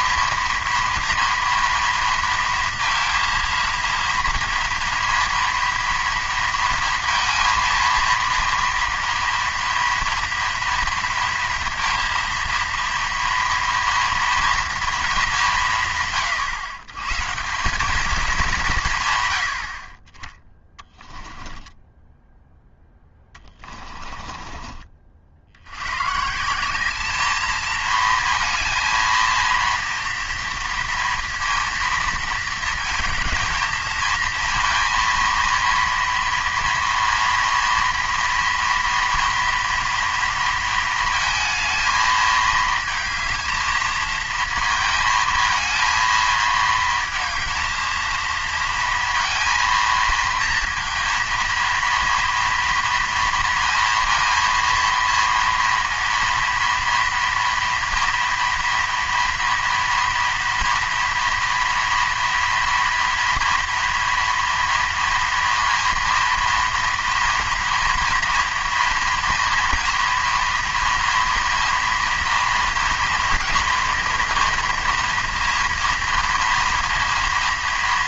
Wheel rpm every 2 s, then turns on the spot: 230, 230, 230, 230, 230, 230, 230, 230, 120, 180, 10, 0, 30, 190, 230, 230, 230, 230, 230, 230, 230, 220, 220, 230, 230, 230, 230, 230, 230, 230, 230, 230, 230, 230, 230, 230, 230, 230, 230.
20-22